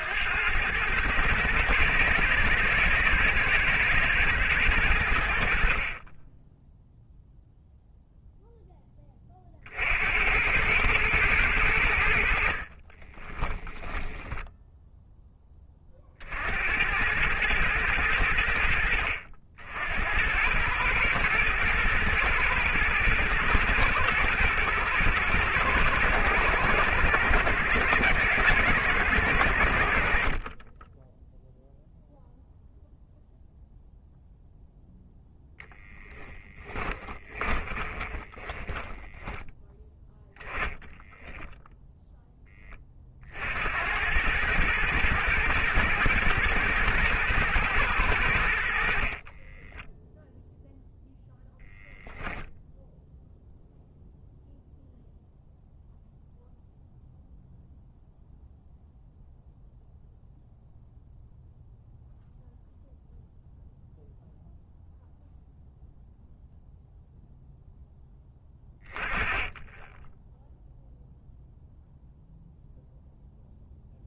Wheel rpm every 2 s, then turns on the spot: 110, 110, 90, 0, 10, 100, 30, 0, 90, 70, 110, 120, 110, 110, 110, 10, 0, 0, 20, 10, 10, 30, 110, 120, 60, 0, 0, 0, 0, 0, 0, 0, 0, 0, 20, 0, 0.
36-42